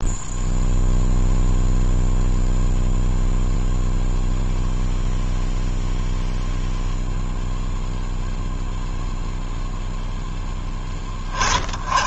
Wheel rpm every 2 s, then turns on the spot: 0, 0, 0, 0, 0, 10.
none